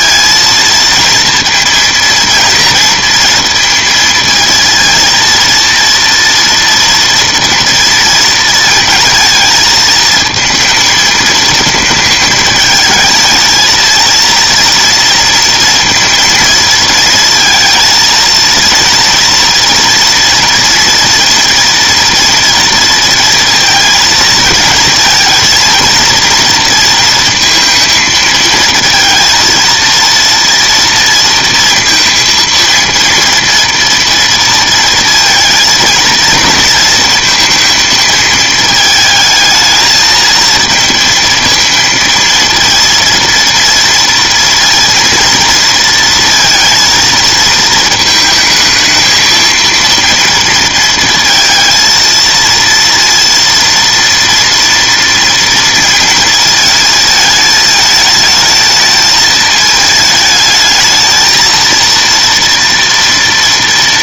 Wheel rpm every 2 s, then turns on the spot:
230, 230, 230, 230, 220, 220, 220, 230, 230, 230, 240, 230, 220, 230, 230, 230, 230, 230, 230, 220, 230, 230, 230, 230, 220, 230, 230, 230, 220, 220, 220, 230.
none